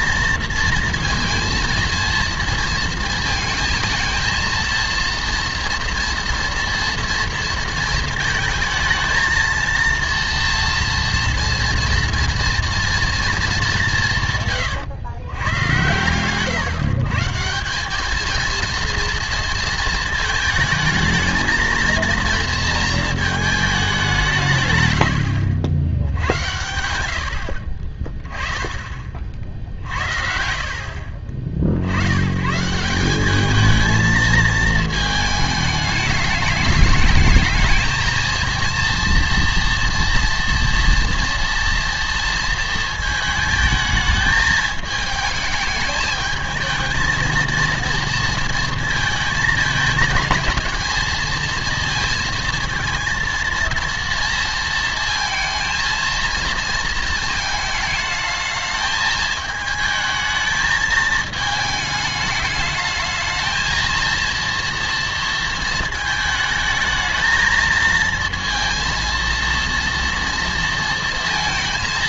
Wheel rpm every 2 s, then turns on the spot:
230, 230, 230, 230, 220, 230, 230, 140, 130, 230, 220, 230, 160, 100, 20, 50, 160, 220, 210, 230, 230, 230, 220, 220, 230, 230, 230, 230, 230, 220, 220, 210, 230, 220, 230, 230.
none